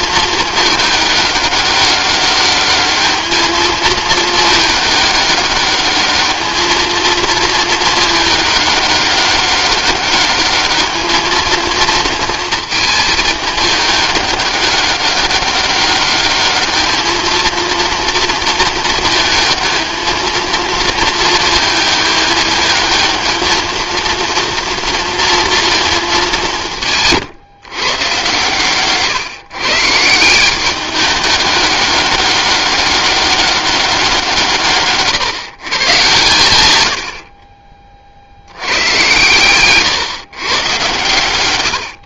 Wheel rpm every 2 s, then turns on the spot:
210, 200, 210, 220, 210, 210, 220, 200, 210, 230, 230, 220, 230, 160, 130, 190, 200, 140, 100, 100, 120.
none